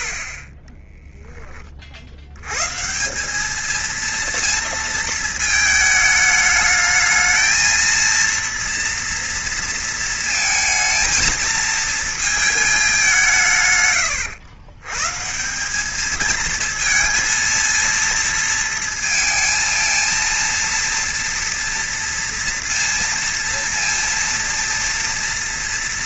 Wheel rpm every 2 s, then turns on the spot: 20, 110, 230, 210, 230, 230, 220, 100, 220, 230, 230, 230, 230.
0-2